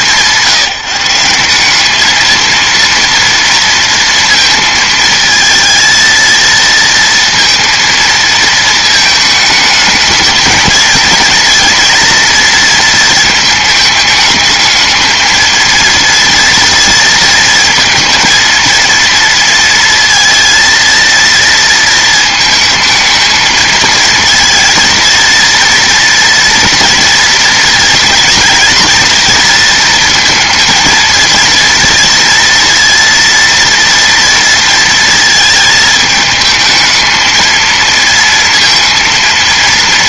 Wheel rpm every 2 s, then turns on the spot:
170, 230, 220, 230, 220, 220, 220, 220, 230, 230, 230, 220, 230, 230, 230, 230, 230, 230, 220, 230.
none